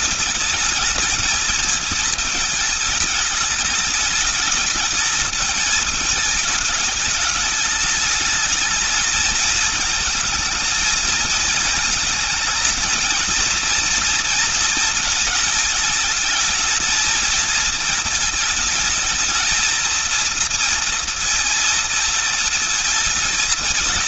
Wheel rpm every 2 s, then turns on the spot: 220, 220, 210, 210, 220, 220, 230, 220, 220, 220, 230, 220.
none